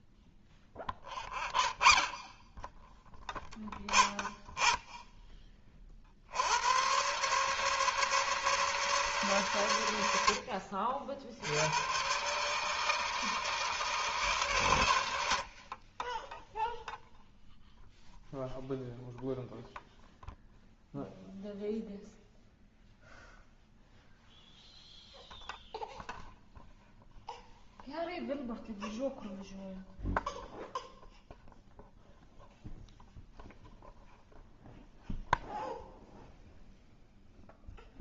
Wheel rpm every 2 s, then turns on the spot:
0, 0, 0, 90, 160, 70, 140, 130, 10, 0, 0, 0, 0, 0, 0, 0, 0, 0, 0.
none